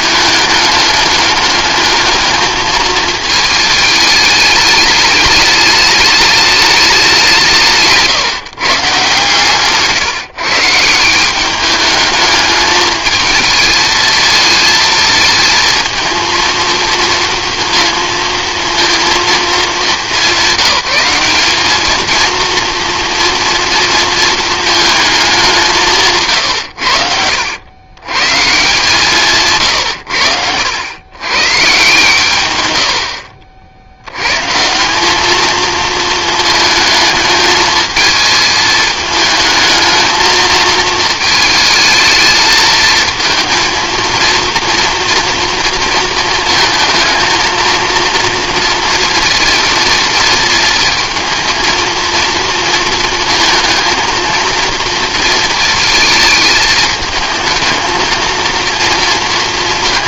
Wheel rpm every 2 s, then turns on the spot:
210, 220, 210, 200, 150, 160, 210, 220, 230, 230, 200, 230, 220, 100, 150, 90, 100, 160, 220, 220, 220, 220, 230, 220, 230, 220, 230, 230, 220, 230.
none